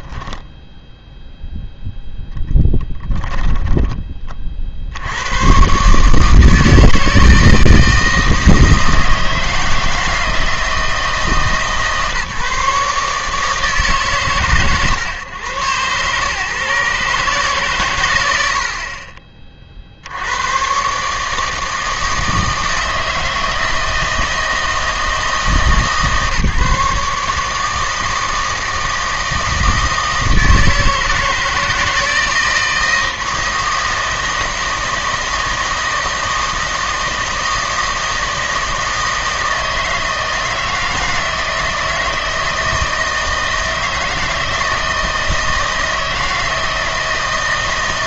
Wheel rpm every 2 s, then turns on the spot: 0, 10, 60, 160, 160, 160, 150, 130, 130, 80, 90, 160, 160, 150, 160, 160, 160, 160, 160, 160, 160, 160, 160, 170.
none